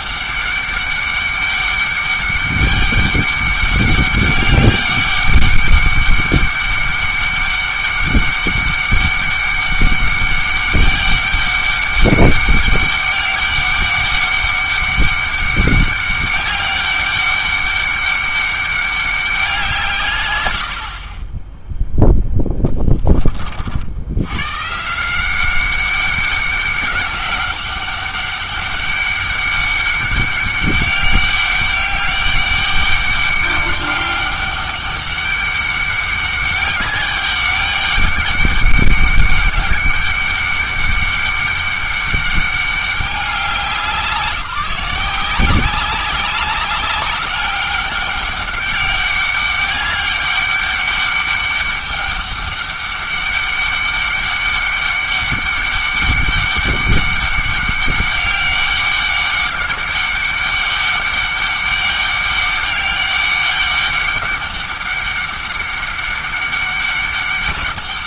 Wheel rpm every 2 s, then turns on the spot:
200, 200, 200, 200, 200, 200, 200, 200, 200, 200, 70, 10, 140, 190, 200, 200, 200, 200, 200, 200, 200, 200, 180, 200, 200, 200, 200, 200, 200, 200, 200, 200, 200, 200.
none